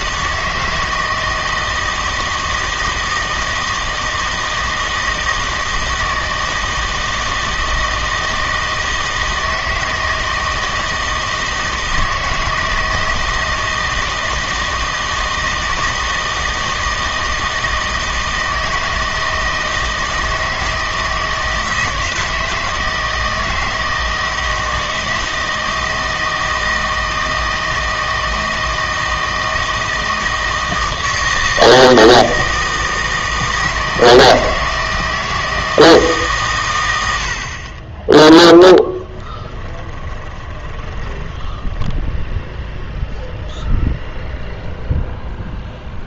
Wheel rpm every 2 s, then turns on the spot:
160, 160, 160, 160, 160, 160, 160, 160, 160, 160, 160, 160, 160, 160, 160, 160, 160, 160, 110, 10, 20, 0, 0.
38-42